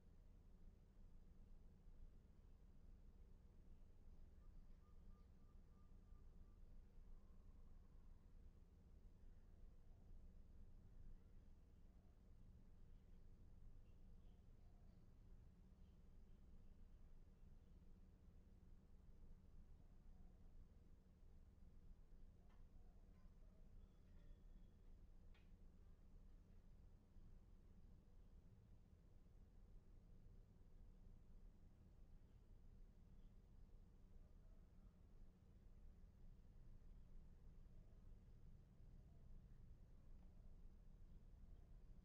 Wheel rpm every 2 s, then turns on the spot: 0, 0, 0, 0, 0, 0, 0, 0, 0, 0, 0, 0, 0, 0, 0, 0, 0, 0, 0, 0, 0.
none